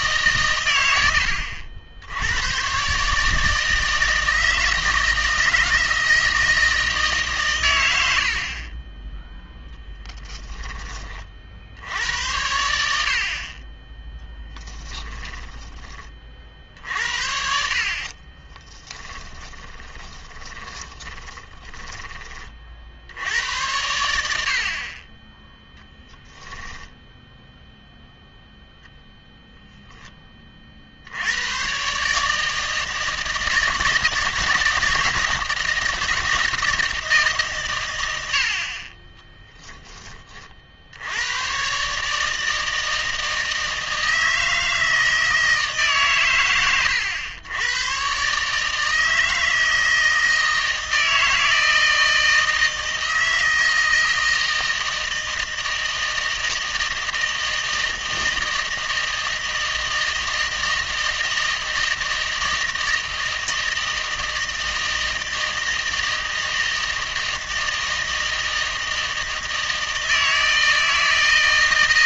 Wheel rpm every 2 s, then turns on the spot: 100, 130, 160, 160, 30, 30, 70, 10, 50, 10, 20, 60, 40, 10, 0, 50, 160, 160, 170, 50, 60, 160, 160, 110, 150, 160, 160, 160, 160, 160, 160, 160, 160, 160, 160, 160.
10-12 14-16 18-22 26-28